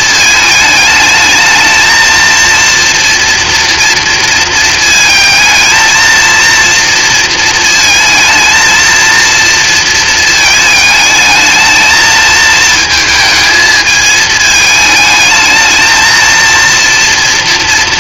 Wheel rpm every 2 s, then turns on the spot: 220, 230, 230, 230, 230, 220, 220, 220, 230.
none